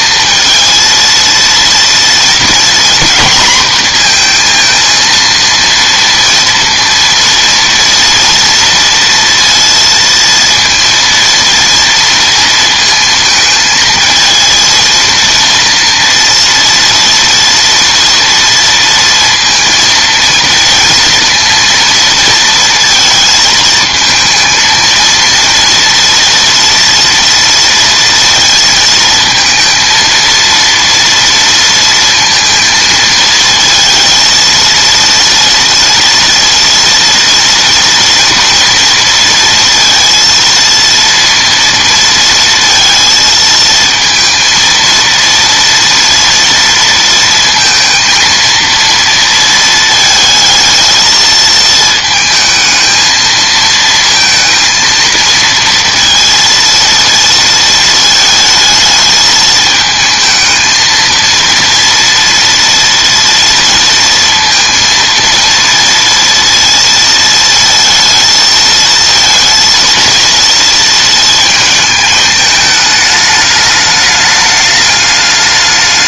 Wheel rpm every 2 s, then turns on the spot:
230, 240, 230, 230, 230, 230, 230, 230, 230, 230, 230, 230, 220, 230, 230, 230, 220, 230, 230, 230, 230, 230, 230, 230, 230, 220, 220, 230, 230, 220, 220, 230, 230, 230, 220, 230, 210, 210.
none